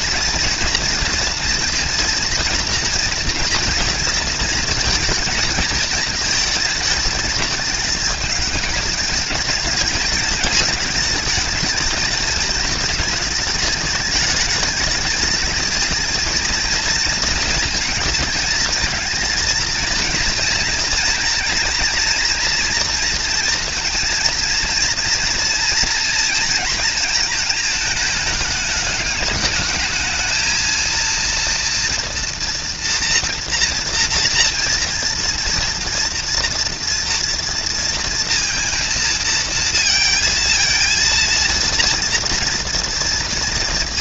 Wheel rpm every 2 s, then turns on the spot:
230, 230, 220, 220, 210, 220, 220, 220, 230, 220, 230, 230, 230, 230, 210, 220, 230, 230, 230, 230, 230, 230.
none